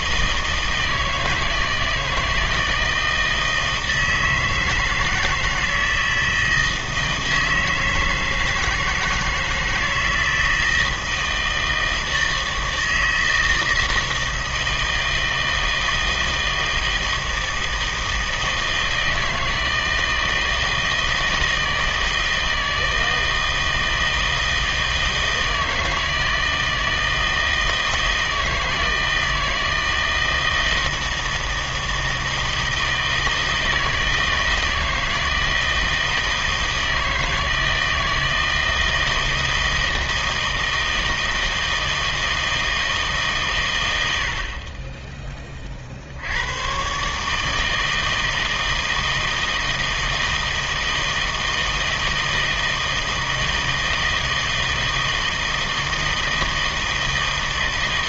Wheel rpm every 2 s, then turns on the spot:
160, 160, 160, 160, 160, 160, 160, 160, 160, 160, 160, 160, 160, 160, 160, 160, 160, 160, 160, 160, 160, 160, 50, 110, 160, 160, 160, 160, 160.
none